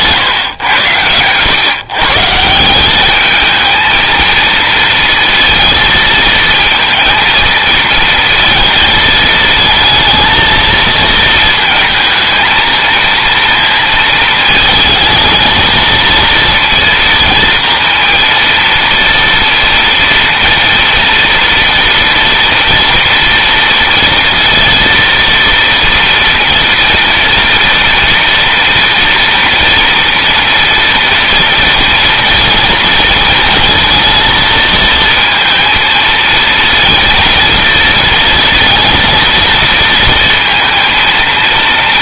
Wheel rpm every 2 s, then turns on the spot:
110, 190, 230, 230, 220, 220, 230, 220, 230, 230, 230, 230, 230, 230, 230, 230, 240, 220, 230, 230, 230.
none